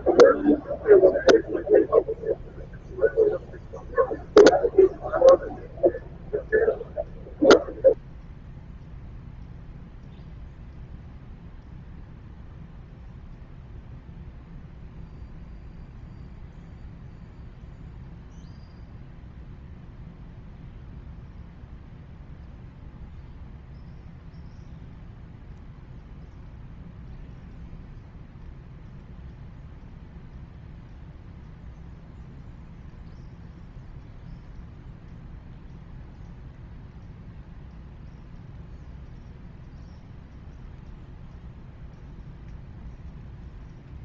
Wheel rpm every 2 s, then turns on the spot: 0, 0, 0, 0, 0, 0, 0, 0, 0, 0, 0, 0, 0, 0, 0, 0, 0, 0, 0, 0, 0, 0.
none